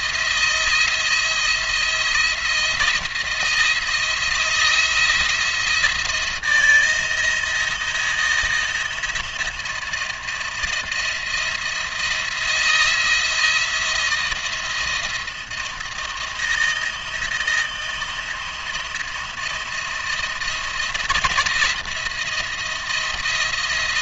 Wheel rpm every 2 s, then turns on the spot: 170, 170, 170, 170, 170, 170, 170, 170, 160, 170, 170, 170.
none